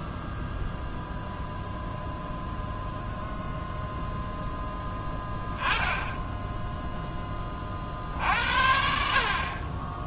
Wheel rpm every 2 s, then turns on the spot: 0, 0, 0, 0, 70.
none